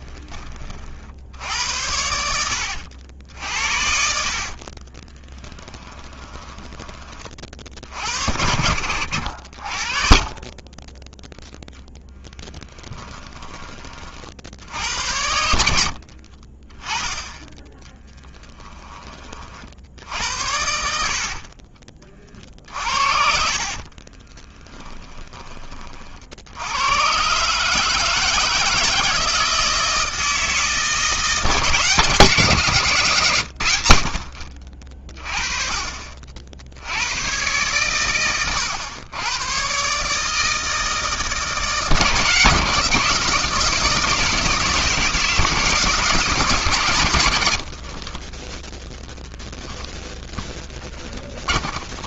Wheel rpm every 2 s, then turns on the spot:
50, 70, 40, 20, 60, 20, 10, 70, 20, 10, 70, 50, 10, 90, 160, 160, 160, 40, 70, 110, 160, 160, 160, 150, 20, 20.
4-6 12-14 22-26 48-50